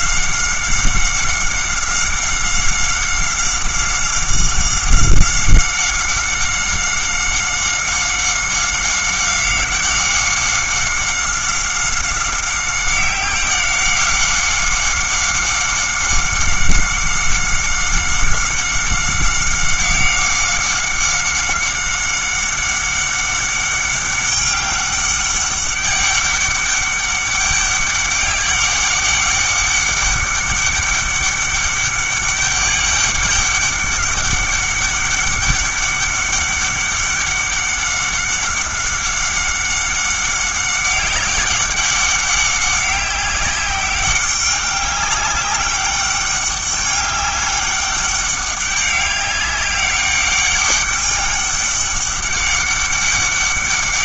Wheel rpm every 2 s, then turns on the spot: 190, 190, 190, 190, 190, 190, 190, 190, 190, 190, 190, 190, 200, 200, 200, 200, 200, 200, 200, 190, 190, 190, 200, 200, 200, 200, 200.
none